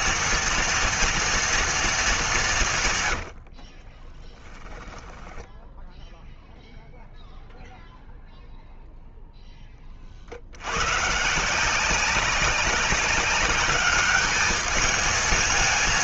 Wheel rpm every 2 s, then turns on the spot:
230, 200, 20, 0, 0, 70, 190, 210.
4-6